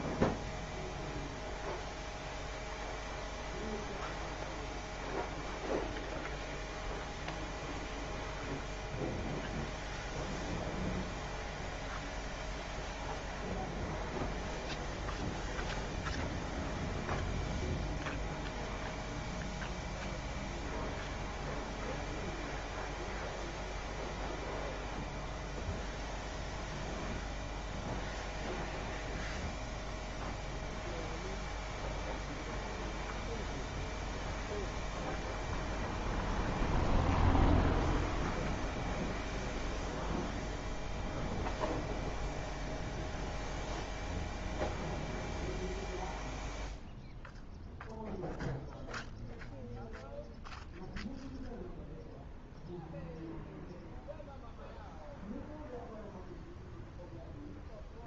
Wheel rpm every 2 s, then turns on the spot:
0, 0, 0, 0, 0, 0, 0, 0, 0, 0, 0, 0, 0, 0, 0, 0, 0, 0, 0, 0, 0, 0, 0, 0, 0, 0, 0, 0, 0.
none